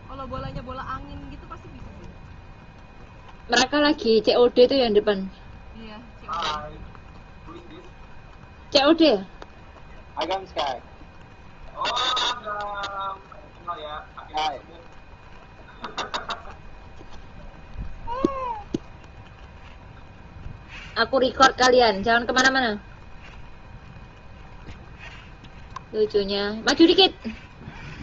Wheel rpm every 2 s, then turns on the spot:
0, 0, 0, 0, 0, 0, 0, 0, 0, 0, 0, 0, 0, 0.
none